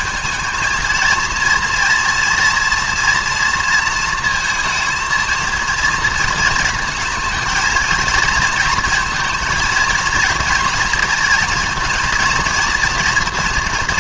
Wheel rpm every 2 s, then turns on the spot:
210, 230, 230, 230, 230, 230, 230.
none